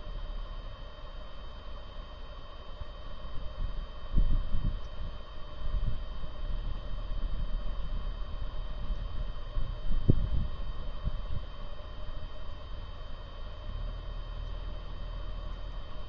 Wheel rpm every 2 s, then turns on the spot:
0, 0, 0, 0, 0, 0, 0, 0.
none